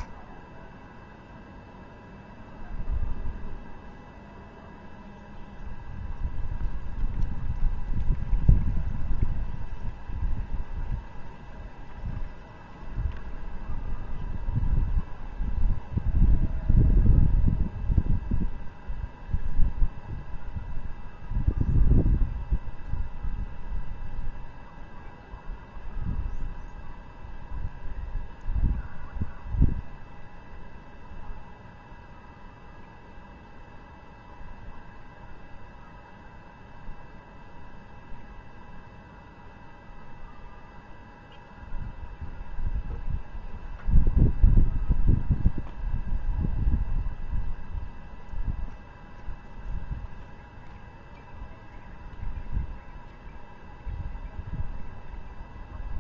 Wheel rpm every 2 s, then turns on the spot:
0, 0, 0, 0, 0, 0, 0, 0, 0, 0, 0, 0, 0, 0, 0, 0, 0, 0, 0, 0, 0, 0, 0, 0, 0, 0, 0, 0.
none